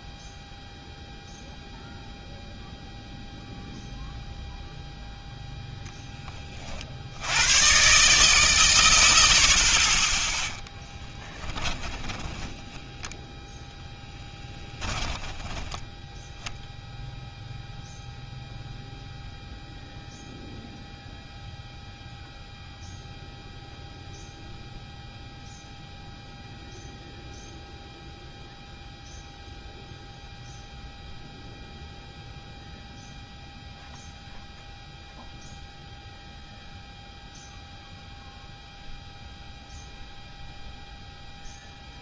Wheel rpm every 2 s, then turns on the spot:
0, 0, 0, 20, 140, 10, 10, 10, 10, 0, 0, 0, 0, 0, 0, 0, 0, 0, 0, 0, 0.
12-16